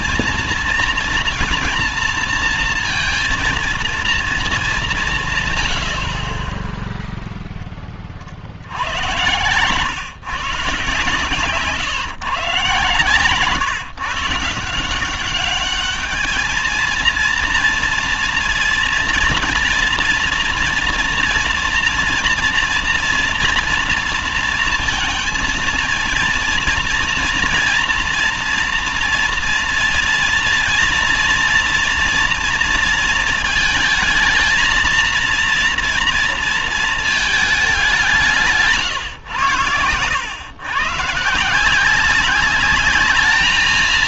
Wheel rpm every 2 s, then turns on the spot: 230, 230, 210, 20, 70, 130, 120, 160, 220, 230, 230, 230, 230, 230, 230, 230, 230, 220, 230, 160, 120, 200.
none